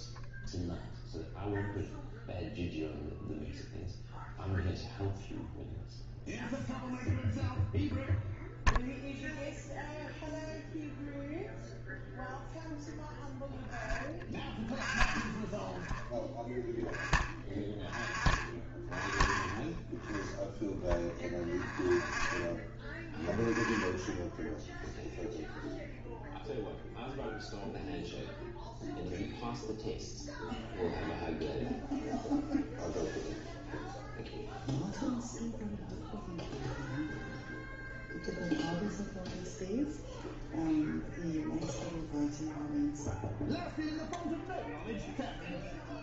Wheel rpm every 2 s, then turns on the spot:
0, 0, 0, 0, 0, 0, 0, 0, 0, 0, 0, 0, 0, 0, 0, 0, 0, 0, 0, 0, 0, 0, 0.
none